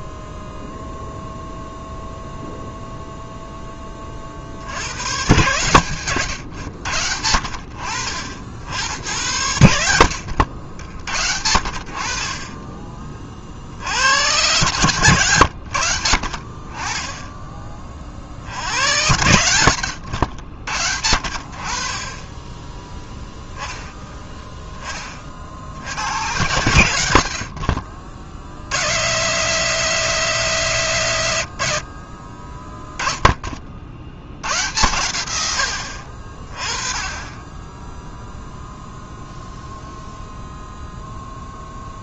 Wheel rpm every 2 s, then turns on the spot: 0, 0, 80, 90, 80, 70, 30, 110, 40, 80, 80, 10, 20, 90, 90, 140, 10, 100, 30, 0, 0.
none